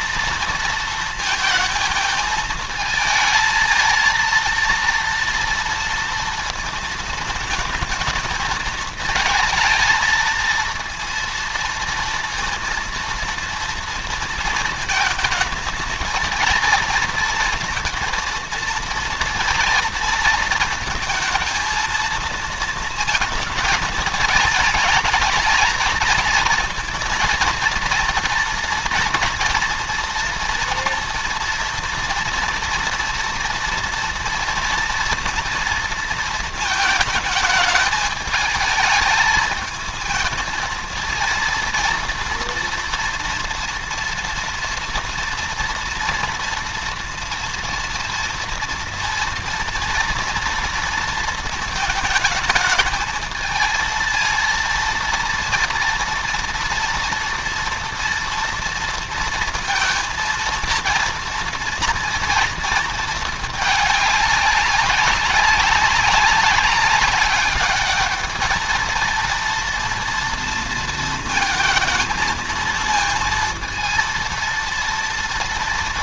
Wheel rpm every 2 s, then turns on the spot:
230, 220, 230, 230, 220, 230, 230, 230, 230, 230, 230, 230, 220, 230, 230, 230, 230, 230, 220, 220, 220, 230, 230, 230, 230, 230, 220, 230, 230, 230, 230, 230, 200, 200, 220, 230, 230, 230.
none